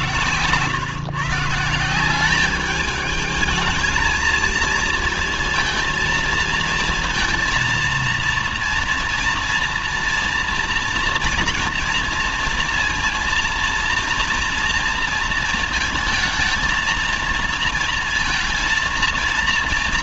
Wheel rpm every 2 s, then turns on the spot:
130, 200, 220, 230, 230, 230, 230, 230, 230, 230.
none